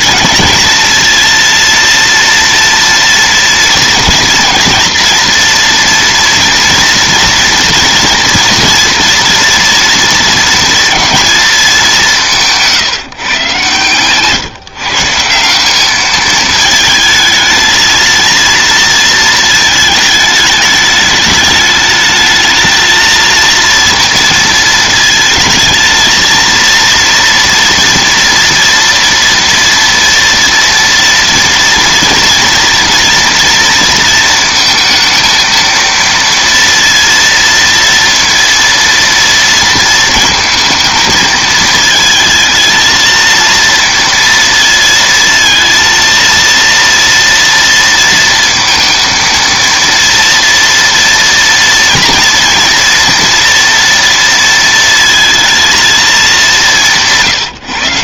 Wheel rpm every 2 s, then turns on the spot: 230, 230, 230, 230, 230, 230, 160, 140, 220, 230, 210, 220, 220, 230, 230, 230, 230, 230, 230, 230, 220, 230, 230, 230, 230, 230, 230, 230, 180.
none